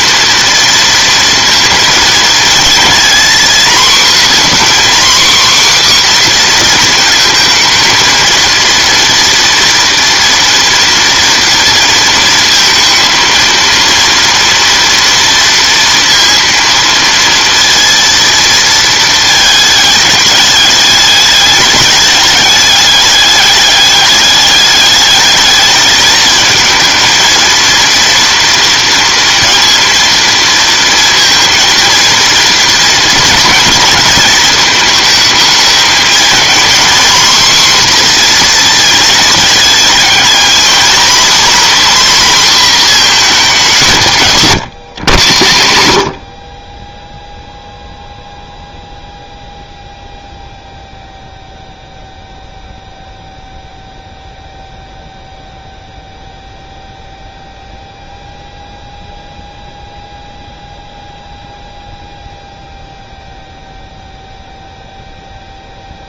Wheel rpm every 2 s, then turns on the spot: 230, 230, 260, 240, 230, 230, 230, 230, 230, 230, 210, 200, 210, 220, 230, 230, 230, 220, 240, 240, 240, 250, 130, 30, 0, 0, 0, 0, 0, 0, 0, 0, 0.
none